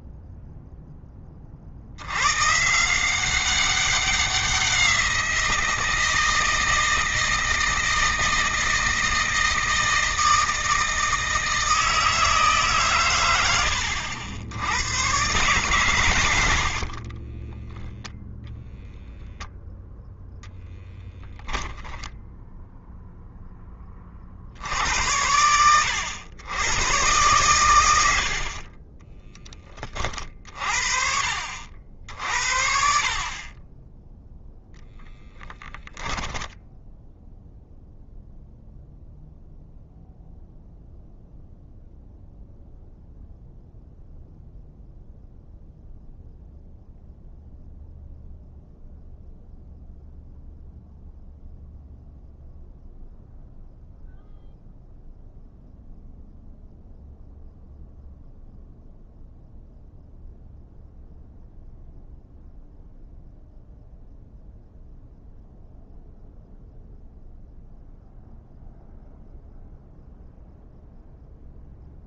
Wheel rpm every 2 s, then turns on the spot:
20, 180, 170, 160, 160, 160, 120, 120, 20, 0, 10, 10, 100, 110, 20, 50, 40, 10, 0, 0, 0, 0, 0, 0, 0, 0, 0, 0, 0, 0, 0, 0, 0, 0, 0, 0.
16-18 34-36